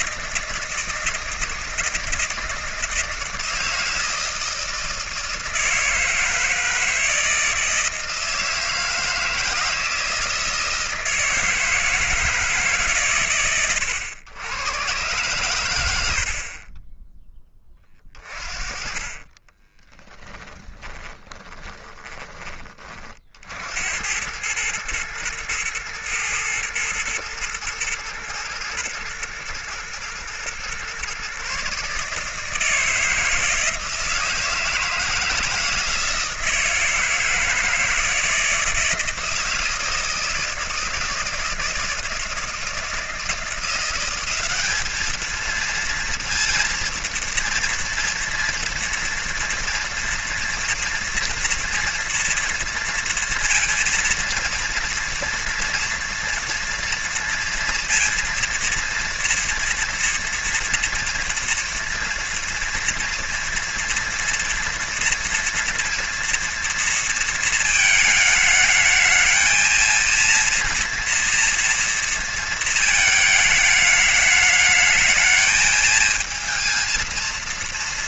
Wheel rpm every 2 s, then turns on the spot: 170, 160, 160, 160, 160, 160, 140, 120, 20, 30, 20, 40, 110, 110, 110, 120, 160, 160, 160, 160, 160, 160, 210, 230, 230, 230, 230, 230, 230, 230, 230, 230, 230, 230, 220, 230, 220, 210, 230.
20-22